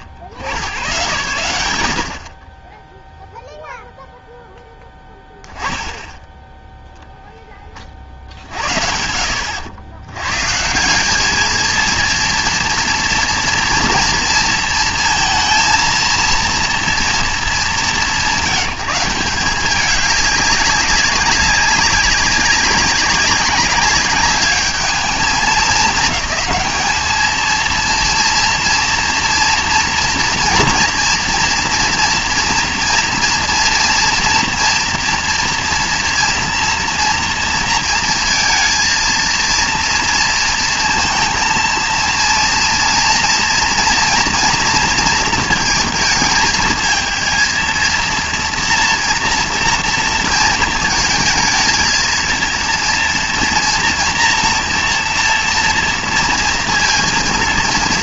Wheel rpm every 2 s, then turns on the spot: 60, 30, 0, 0, 60, 150, 230, 230, 230, 160, 200, 190, 210, 210, 230, 230, 230, 230, 240, 230, 230, 230, 230, 220, 230, 230, 230, 230, 230.
none